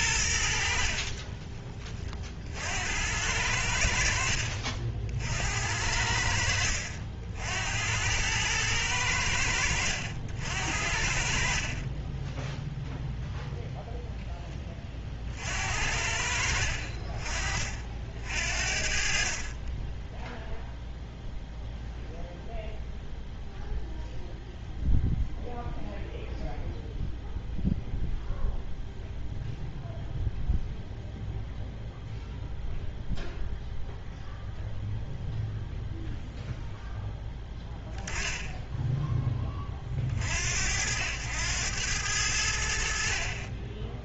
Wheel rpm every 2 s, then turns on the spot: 50, 80, 60, 70, 100, 60, 0, 30, 50, 60, 0, 0, 0, 0, 0, 0, 0, 0, 0, 0, 80, 80.
0-2